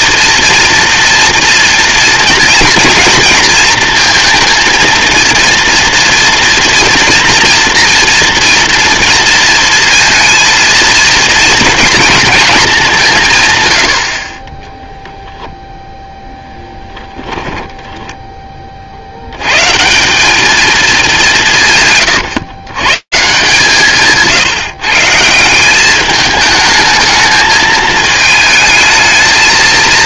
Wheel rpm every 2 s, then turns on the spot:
230, 230, 230, 230, 230, 230, 220, 20, 0, 20, 210, 130, 150, 210, 220.
none